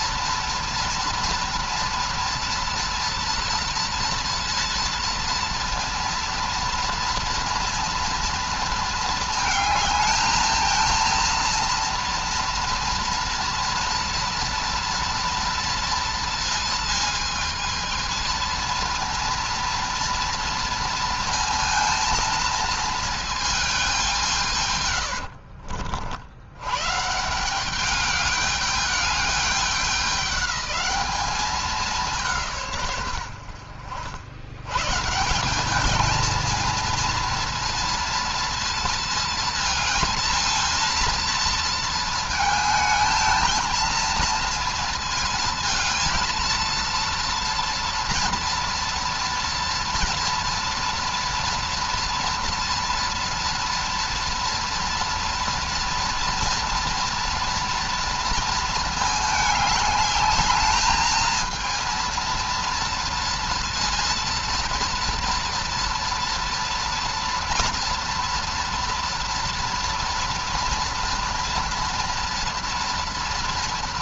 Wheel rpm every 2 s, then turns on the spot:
230, 230, 230, 230, 230, 230, 230, 230, 220, 230, 230, 220, 140, 110, 210, 200, 150, 110, 220, 230, 230, 220, 230, 230, 230, 230, 240, 230, 230, 230, 210, 230, 230, 230, 230, 230, 230.
24-26